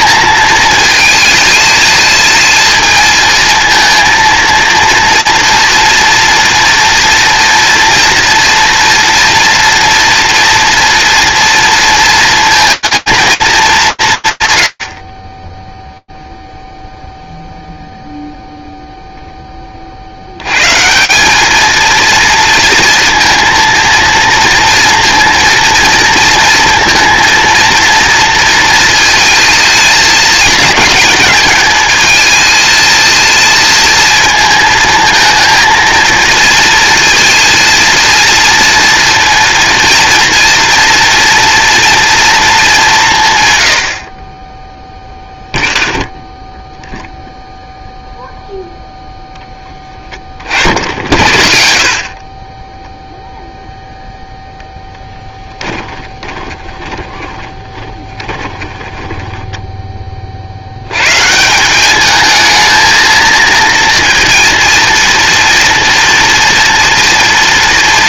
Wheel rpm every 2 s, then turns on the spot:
220, 220, 230, 230, 230, 230, 230, 120, 0, 0, 140, 230, 230, 230, 230, 210, 220, 230, 230, 230, 230, 190, 0, 0, 0, 50, 0, 10, 20, 10, 150, 220, 230, 230.
54-60